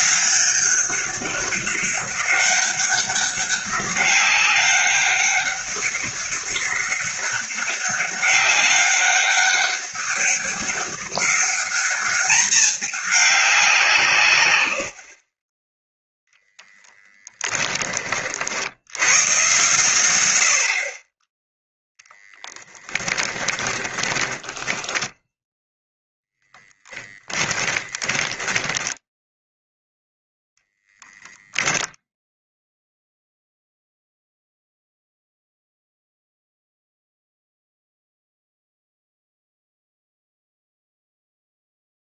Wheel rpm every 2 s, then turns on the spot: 200, 200, 200, 200, 200, 200, 210, 90, 10, 100, 40, 10, 10, 10, 10, 0, 0, 0, 0, 0, 0.
14-18 22-30